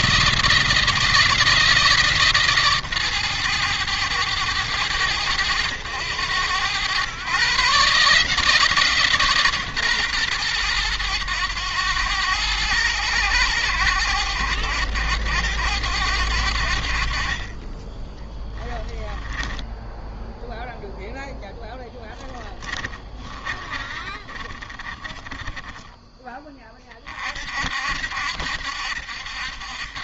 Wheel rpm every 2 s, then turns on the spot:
170, 140, 100, 100, 160, 120, 100, 90, 70, 10, 0, 40, 30, 30, 70.
18-20 22-26